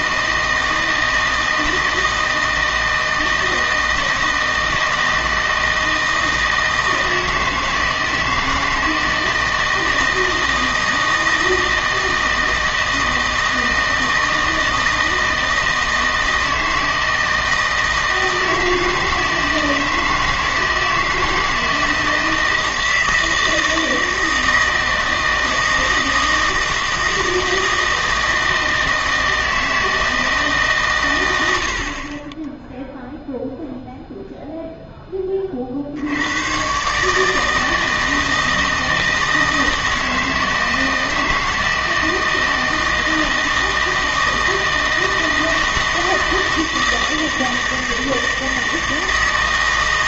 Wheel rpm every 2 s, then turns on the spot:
160, 160, 160, 160, 160, 160, 160, 160, 160, 160, 160, 160, 160, 160, 160, 140, 0, 0, 130, 160, 160, 160, 160, 160, 160.
none